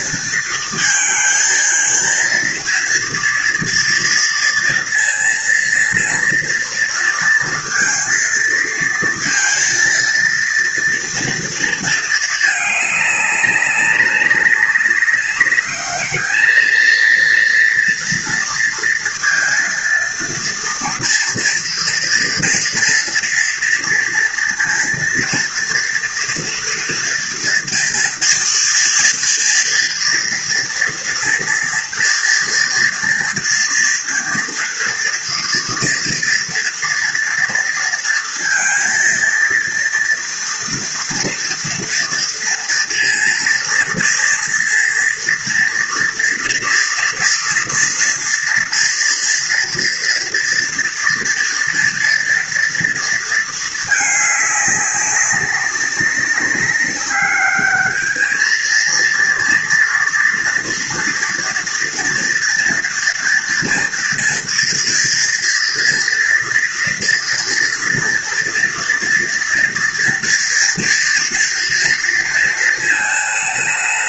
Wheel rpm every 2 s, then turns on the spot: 230, 230, 230, 230, 230, 230, 210, 200, 220, 230, 230, 240, 230, 230, 230, 230, 230, 230, 230, 230, 230, 230, 230, 230, 230, 230, 230, 200, 190, 220, 230, 230, 230, 230, 230, 240, 230.
none